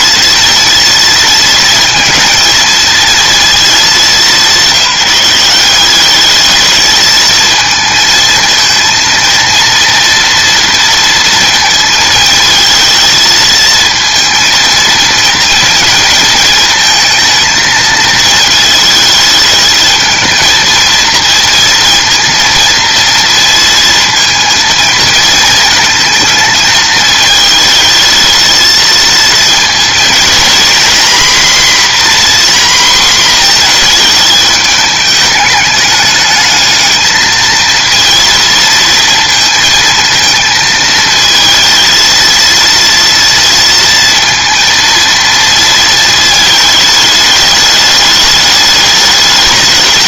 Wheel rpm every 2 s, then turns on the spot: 220, 230, 200, 210, 230, 230, 220, 230, 220, 220, 230, 230, 230, 220, 220, 230, 250, 220, 210, 230, 230, 230, 230, 220, 210.
none